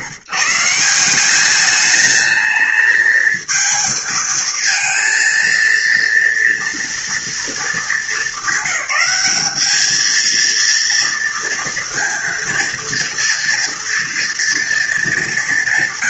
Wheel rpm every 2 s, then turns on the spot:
170, 220, 230, 230, 210, 230, 230, 230.
none